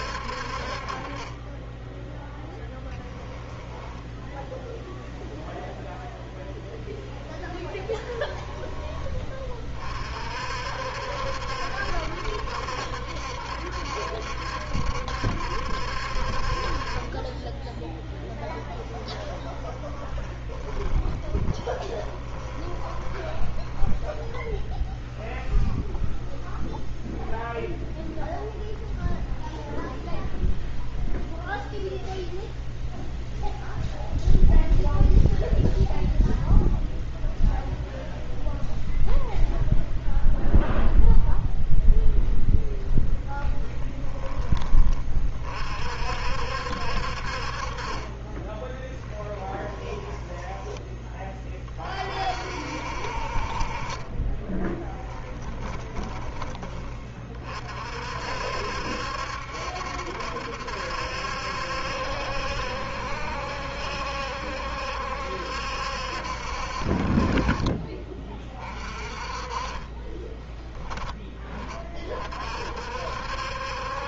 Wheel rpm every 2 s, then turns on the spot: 40, 10, 0, 10, 20, 60, 70, 70, 40, 10, 20, 20, 0, 0, 0, 0, 0, 0, 0, 0, 0, 0, 20, 60, 10, 10, 50, 10, 20, 70, 70, 70, 70, 50, 30, 10, 50.
18-24 48-50 54-56